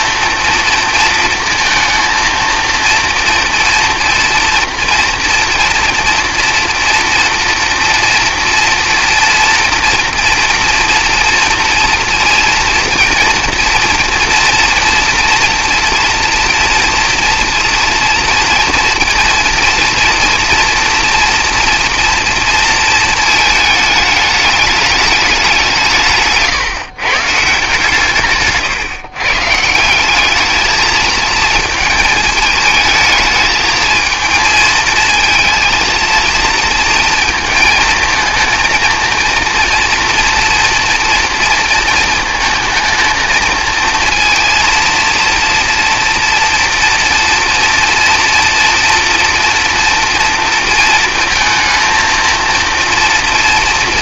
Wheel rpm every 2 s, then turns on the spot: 230, 230, 230, 230, 230, 230, 230, 230, 240, 240, 230, 230, 210, 140, 140, 220, 210, 220, 230, 230, 230, 220, 230, 230, 240, 230, 230.
none